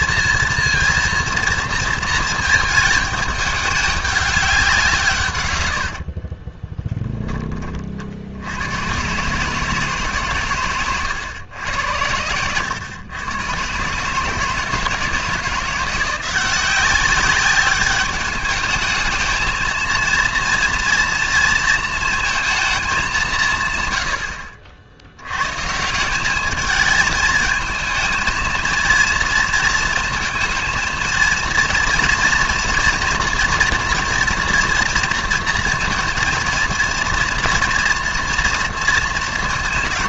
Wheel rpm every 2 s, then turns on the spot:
230, 220, 190, 40, 100, 130, 100, 150, 180, 210, 230, 220, 70, 210, 220, 220, 230, 230, 230, 230.
6-8